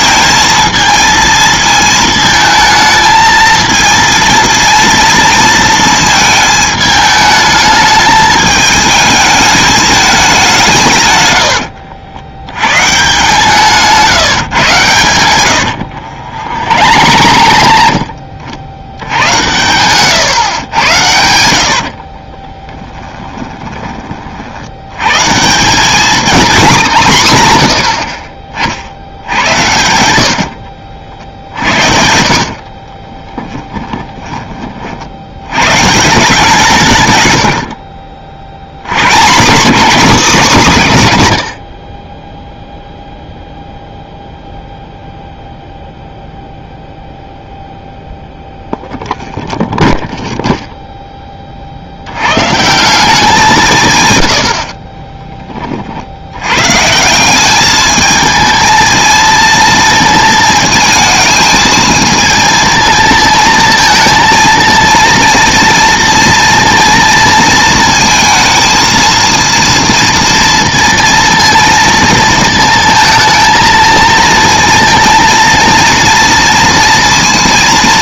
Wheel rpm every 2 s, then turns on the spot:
220, 220, 230, 220, 220, 170, 120, 140, 70, 60, 110, 20, 70, 210, 50, 60, 50, 30, 170, 60, 200, 0, 0, 0, 0, 0, 140, 80, 120, 220, 220, 230, 230, 230, 220, 230, 220, 230, 230.
16-18 20-24 30-34